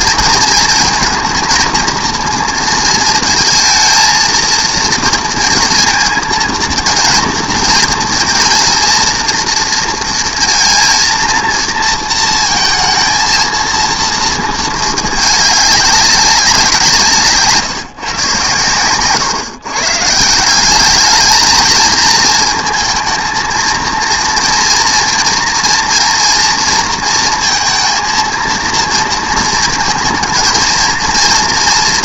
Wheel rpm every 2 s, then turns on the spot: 230, 230, 230, 230, 230, 230, 220, 220, 190, 120, 190, 220, 230, 230, 230, 230.
none